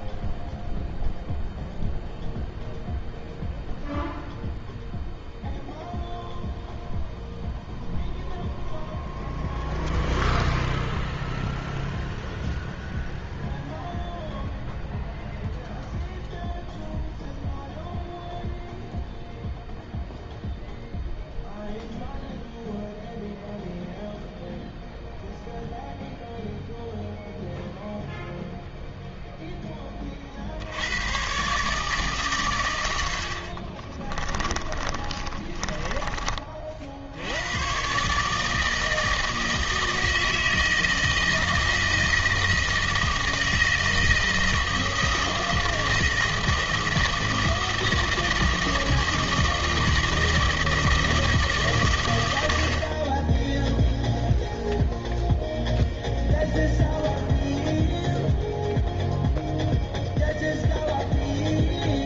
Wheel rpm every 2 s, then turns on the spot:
0, 0, 0, 0, 0, 0, 0, 0, 0, 0, 0, 0, 0, 0, 20, 150, 40, 30, 130, 160, 160, 160, 160, 160, 160, 140, 10, 0, 0, 0, 0.
32-36